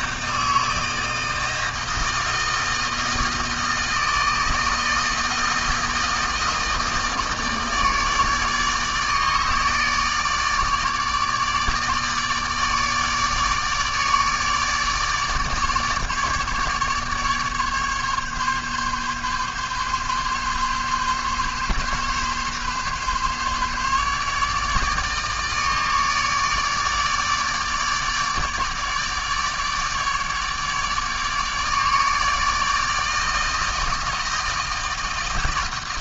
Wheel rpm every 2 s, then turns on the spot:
160, 160, 160, 160, 150, 150, 150, 150, 150, 140, 140, 140, 150, 150, 150, 150, 160, 160.
none